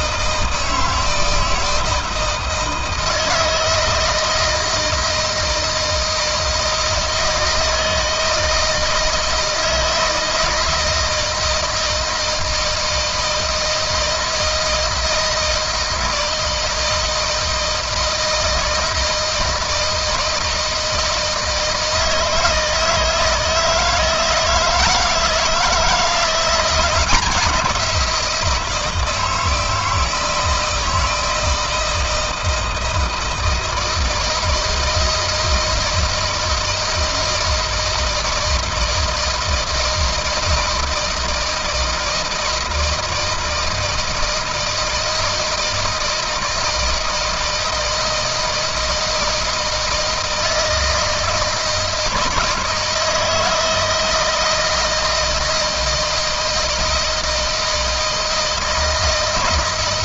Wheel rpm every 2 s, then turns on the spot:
160, 160, 160, 160, 160, 160, 160, 160, 160, 160, 160, 160, 160, 170, 170, 160, 160, 160, 160, 160, 170, 160, 160, 160, 160, 160, 160, 160, 160, 160.
none